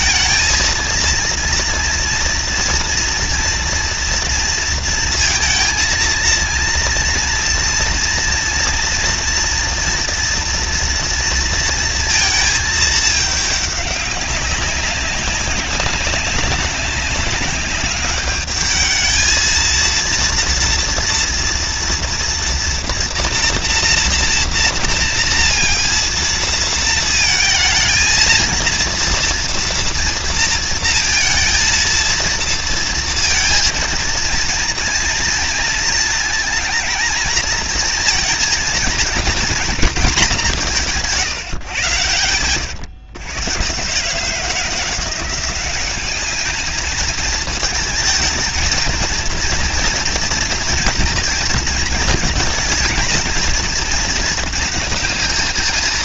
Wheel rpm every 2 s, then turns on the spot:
220, 230, 230, 230, 230, 230, 230, 200, 200, 200, 220, 230, 230, 230, 220, 230, 230, 230, 230, 230, 230, 150, 120, 180, 220, 230, 230, 230.
42-44